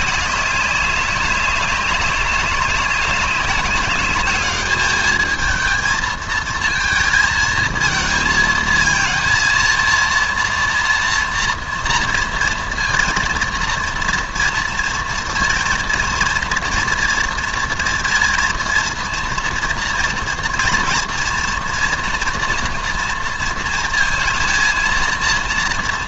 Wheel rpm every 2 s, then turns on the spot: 200, 200, 210, 220, 220, 230, 230, 230, 230, 230, 240, 240, 230.
none